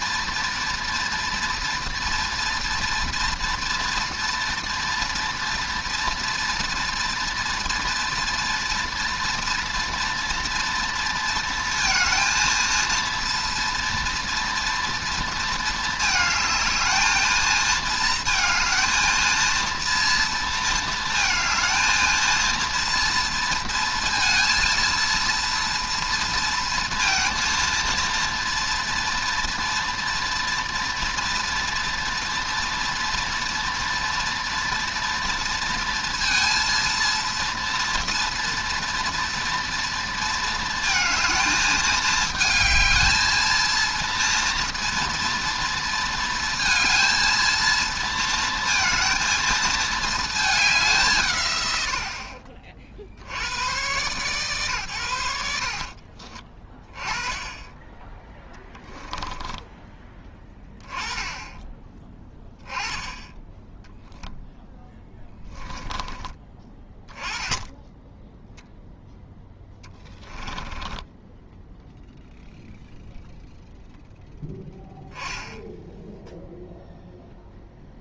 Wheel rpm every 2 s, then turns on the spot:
240, 230, 230, 240, 230, 230, 230, 230, 220, 230, 230, 230, 230, 230, 230, 240, 230, 230, 230, 230, 230, 220, 230, 230, 230, 210, 30, 120, 30, 10, 10, 10, 0, 10, 0, 10, 0, 0, 0.
58-60 70-72